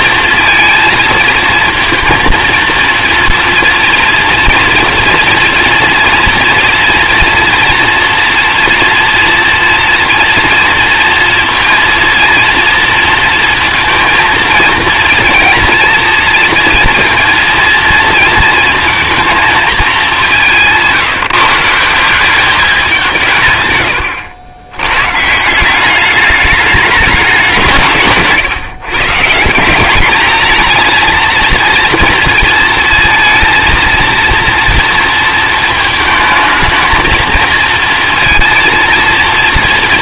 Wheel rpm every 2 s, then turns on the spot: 230, 230, 230, 240, 230, 230, 230, 230, 230, 230, 170, 200, 100, 200, 140, 220, 230, 230, 220, 230.
none